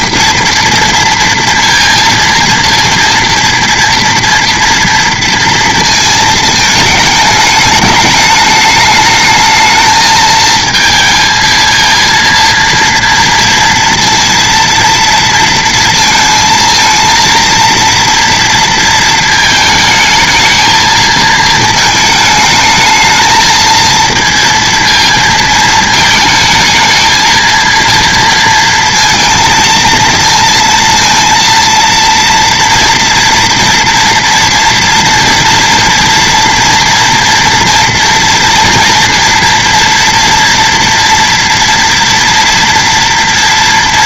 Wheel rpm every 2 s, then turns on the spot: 230, 230, 230, 220, 210, 220, 230, 230, 220, 230, 220, 220, 230, 220, 230, 230, 230, 230, 230, 240, 230, 230.
none